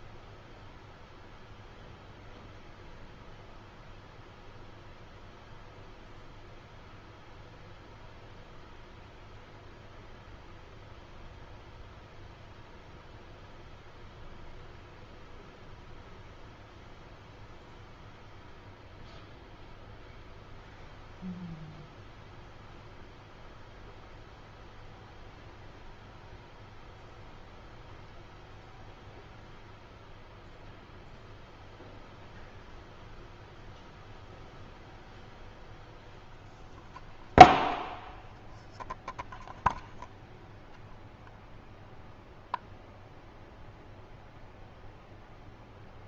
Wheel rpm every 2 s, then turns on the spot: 0, 0, 0, 0, 0, 0, 0, 0, 0, 0, 0, 0, 0, 0, 0, 0, 0, 0, 0, 0, 0, 0, 0.
none